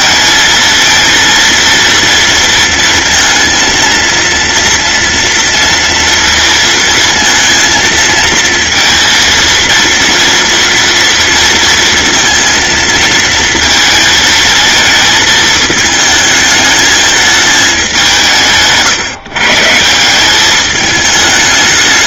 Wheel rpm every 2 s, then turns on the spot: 230, 230, 230, 230, 230, 230, 220, 220, 220, 150, 210.
none